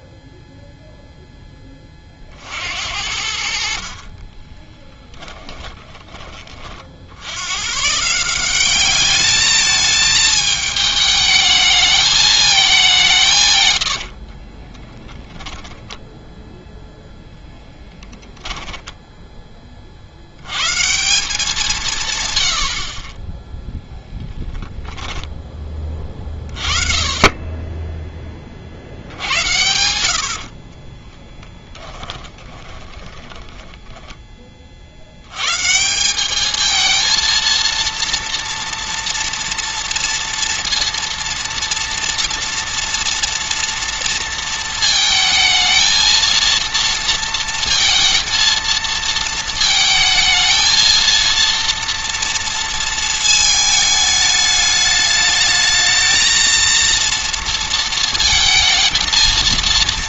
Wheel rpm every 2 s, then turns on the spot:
0, 70, 10, 50, 200, 220, 200, 20, 0, 10, 150, 60, 0, 30, 60, 40, 20, 50, 220, 230, 230, 230, 230, 230, 230, 230, 220, 210, 230, 220.
4-6 14-16 18-20 30-34